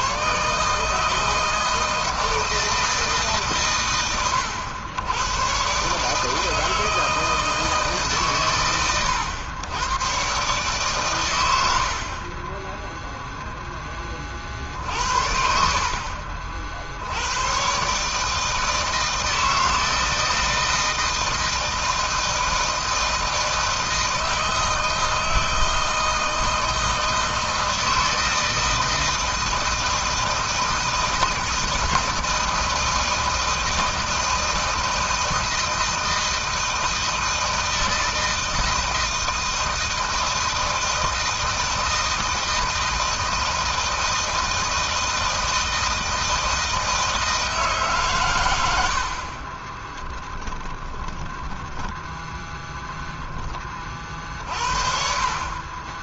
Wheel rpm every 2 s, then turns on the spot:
160, 150, 110, 160, 100, 110, 10, 60, 100, 160, 160, 160, 160, 160, 160, 160, 160, 160, 160, 160, 160, 160, 160, 160, 50, 10, 10, 40.
48-52